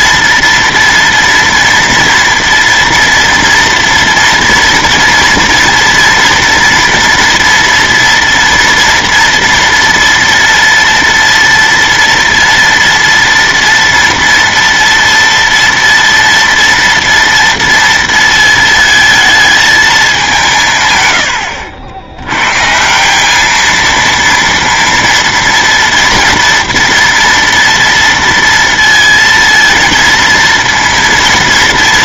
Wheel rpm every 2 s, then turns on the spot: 240, 230, 230, 240, 230, 240, 230, 230, 230, 220, 140, 150, 230, 230, 230, 230.
none